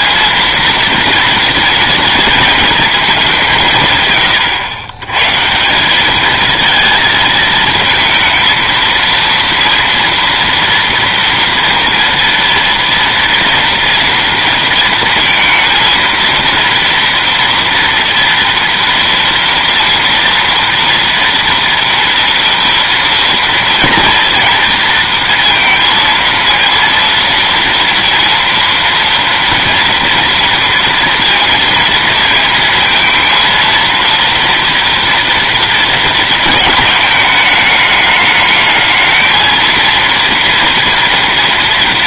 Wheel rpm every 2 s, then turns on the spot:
230, 130, 190, 230, 230, 230, 230, 230, 230, 230, 230, 230, 230, 230, 230, 230, 230, 220, 210, 230, 230.
none